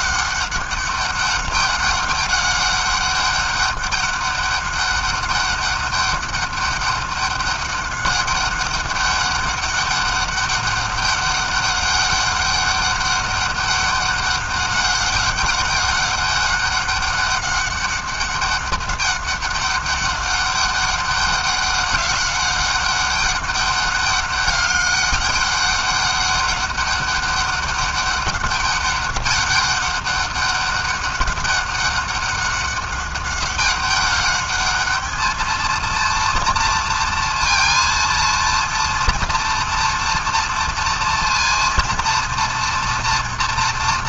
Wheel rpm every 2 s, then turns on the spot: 200, 200, 200, 200, 200, 200, 200, 200, 200, 200, 200, 200, 200, 200, 200, 190, 200, 210, 230, 230, 230, 240.
none